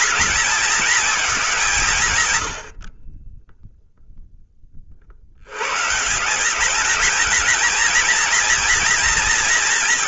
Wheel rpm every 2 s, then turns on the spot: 220, 10, 110, 230, 220.
none